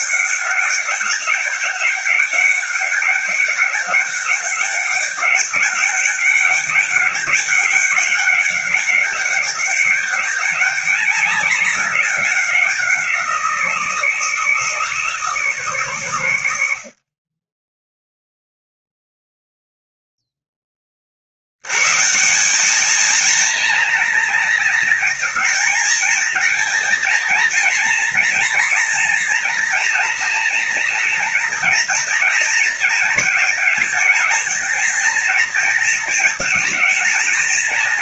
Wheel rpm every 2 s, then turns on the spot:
200, 200, 200, 200, 190, 200, 180, 170, 50, 0, 40, 220, 230, 230, 230, 240, 220, 220, 220.
none